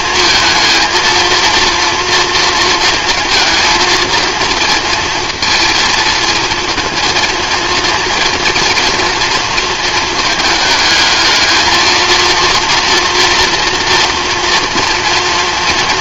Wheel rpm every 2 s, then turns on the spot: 220, 230, 230, 220, 230, 220, 230, 230.
none